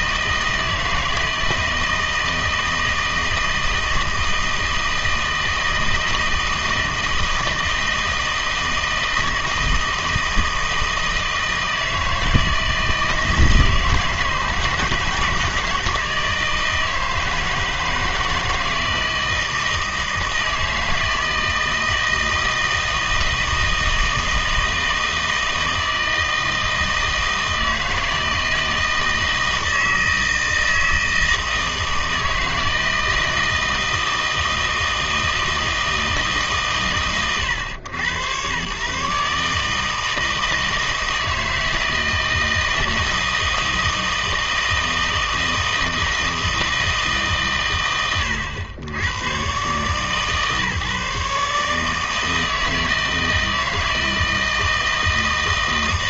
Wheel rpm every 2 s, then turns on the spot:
160, 160, 160, 160, 160, 160, 160, 160, 160, 160, 160, 160, 160, 160, 160, 160, 160, 160, 150, 110, 160, 160, 160, 160, 100, 140, 160, 160.
none